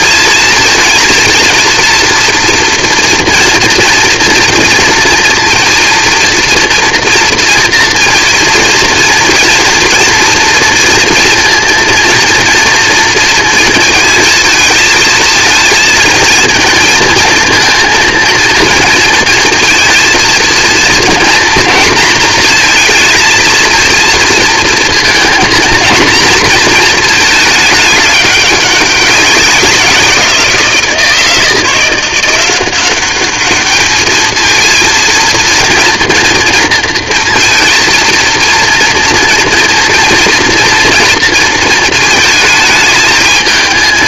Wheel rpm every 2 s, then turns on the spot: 220, 230, 230, 230, 230, 230, 230, 220, 230, 230, 230, 230, 230, 230, 200, 170, 190, 220, 230, 230, 240, 220.
none